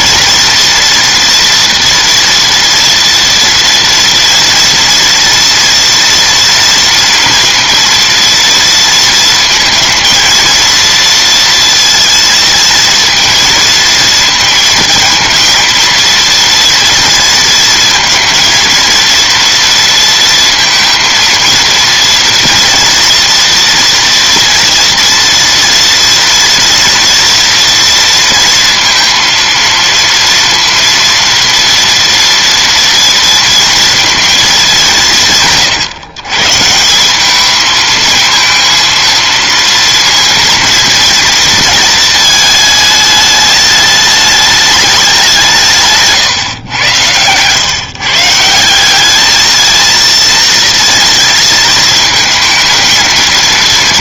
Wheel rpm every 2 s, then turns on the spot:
230, 230, 230, 240, 230, 230, 230, 230, 230, 230, 230, 230, 230, 230, 230, 230, 230, 190, 170, 230, 230, 210, 210, 120, 190, 230, 220.
none